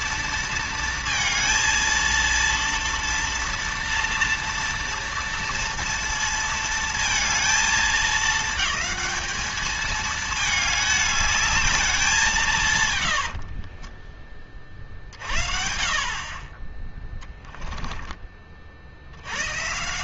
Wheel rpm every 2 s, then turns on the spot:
230, 230, 230, 230, 210, 210, 150, 40, 20, 60.
none